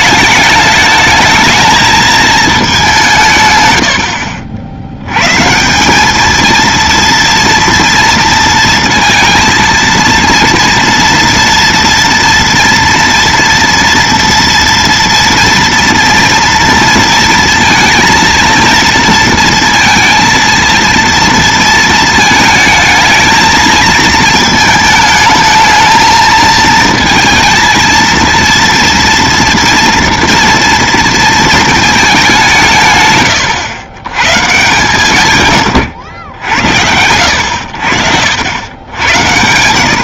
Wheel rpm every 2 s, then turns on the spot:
220, 100, 170, 230, 230, 230, 230, 230, 230, 230, 230, 220, 220, 230, 240, 220, 90, 110, 70, 60.
none